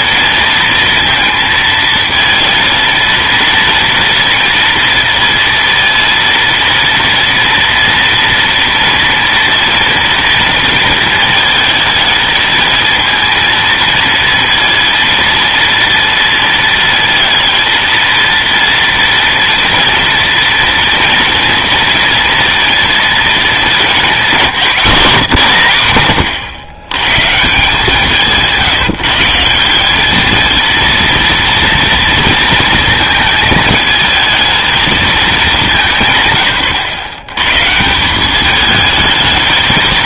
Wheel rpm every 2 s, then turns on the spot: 230, 230, 230, 230, 230, 230, 220, 230, 230, 230, 230, 230, 180, 120, 170, 230, 230, 220, 140, 210.
none